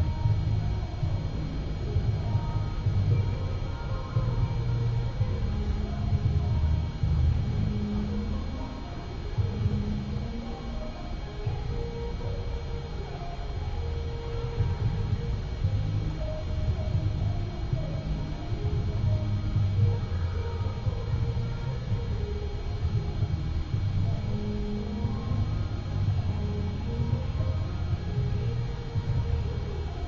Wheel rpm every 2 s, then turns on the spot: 0, 0, 0, 0, 0, 0, 0, 0, 0, 0, 0, 0, 0, 0, 0.
none